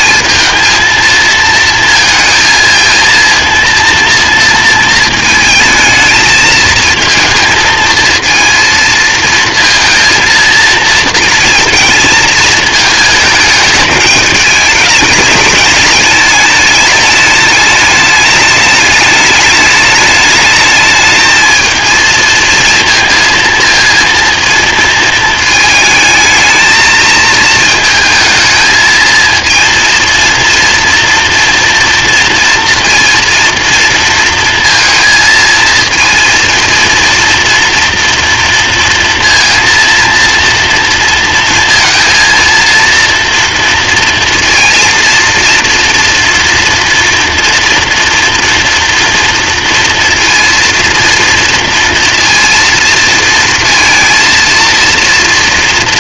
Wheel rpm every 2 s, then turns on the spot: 230, 230, 230, 220, 230, 230, 220, 210, 210, 210, 210, 220, 220, 220, 220, 230, 230, 230, 230, 230, 230, 230, 230, 230, 240, 230, 230, 230.
none